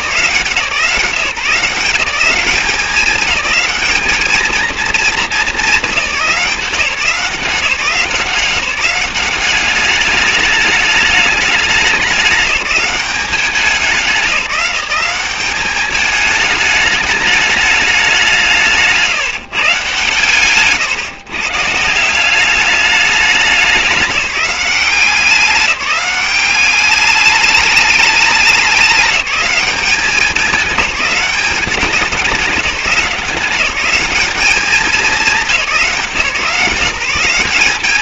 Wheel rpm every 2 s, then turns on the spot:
160, 190, 220, 170, 190, 210, 190, 180, 210, 170, 140, 200, 190, 200, 200, 200, 180, 210, 160.
20-22